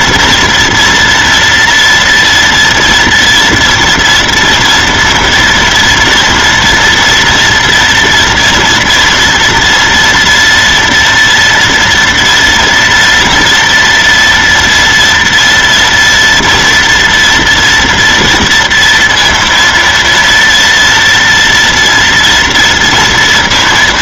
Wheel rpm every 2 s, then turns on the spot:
230, 230, 240, 240, 230, 230, 230, 230, 230, 230, 230, 230.
none